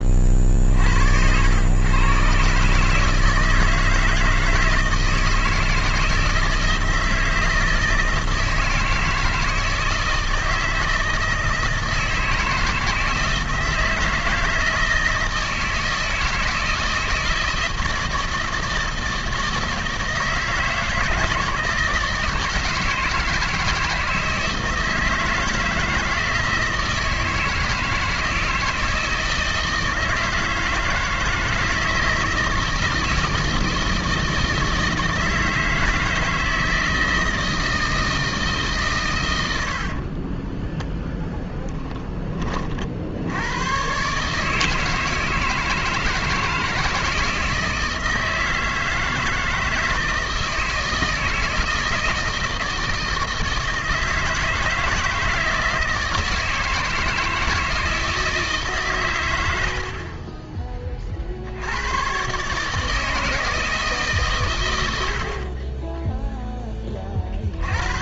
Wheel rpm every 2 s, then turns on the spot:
50, 140, 160, 160, 160, 160, 160, 160, 160, 160, 160, 160, 160, 160, 160, 160, 160, 160, 160, 150, 10, 50, 160, 160, 160, 160, 160, 160, 160, 140, 20, 150, 110, 10.
40-42